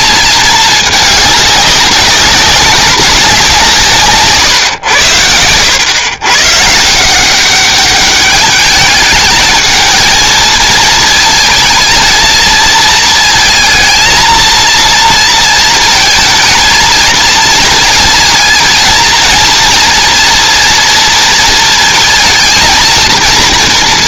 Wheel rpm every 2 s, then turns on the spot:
210, 190, 110, 160, 210, 230, 230, 230, 220, 230, 230, 230.
none